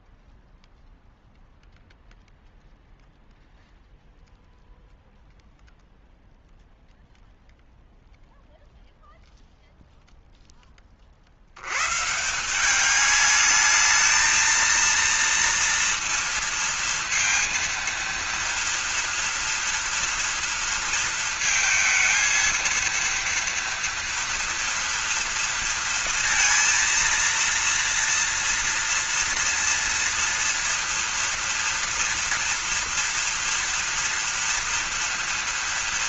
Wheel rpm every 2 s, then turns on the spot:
0, 0, 0, 0, 0, 20, 190, 230, 230, 230, 230, 230, 230, 230, 230, 230, 230, 240.
none